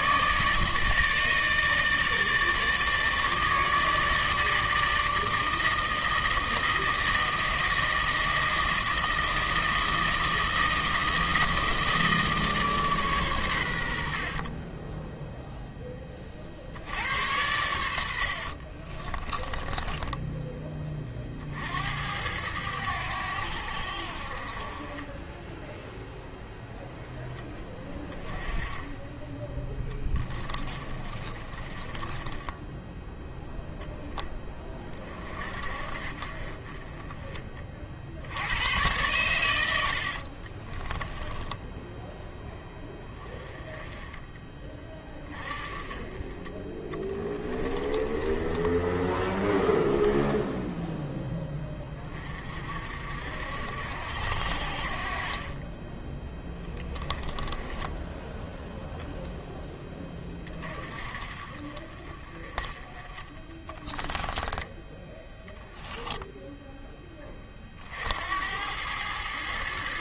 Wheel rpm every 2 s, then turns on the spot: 150, 160, 160, 160, 160, 160, 150, 20, 70, 40, 20, 90, 30, 0, 20, 20, 10, 20, 30, 100, 20, 10, 20, 20, 20, 10, 50, 60, 10, 0, 30, 20, 10, 10, 90.
18-20 30-34 40-42 46-48 56-58 64-66